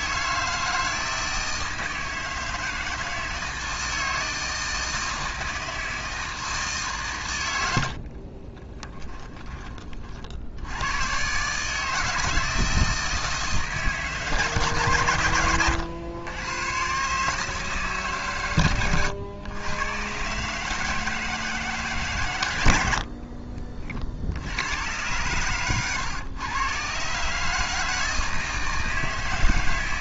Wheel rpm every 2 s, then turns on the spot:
160, 160, 160, 150, 30, 90, 160, 140, 110, 110, 150, 90, 90, 120, 160.
8-10